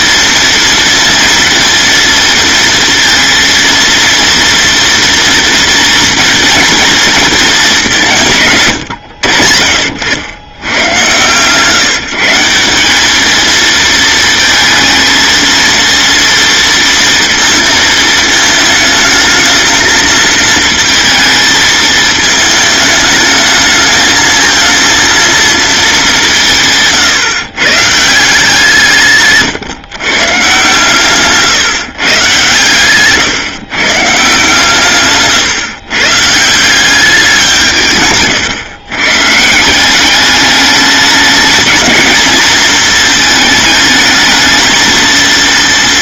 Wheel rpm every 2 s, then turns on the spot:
230, 230, 230, 230, 150, 110, 180, 220, 230, 220, 220, 220, 220, 160, 160, 140, 130, 150, 160, 140, 210, 220, 220.
none